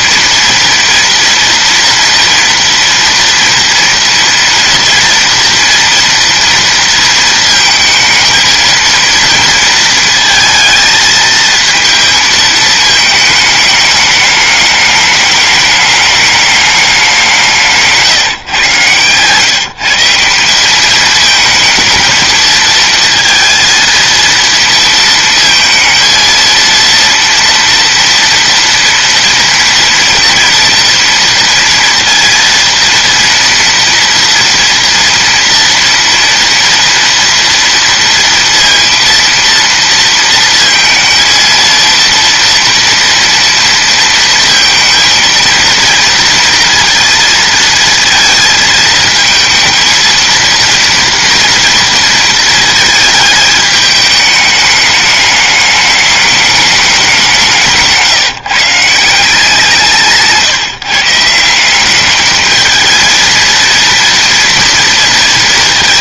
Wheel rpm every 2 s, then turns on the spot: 230, 240, 240, 230, 220, 220, 220, 210, 210, 130, 190, 220, 230, 230, 230, 240, 230, 230, 230, 230, 230, 230, 230, 230, 220, 230, 220, 210, 210, 160, 150, 210, 230.
none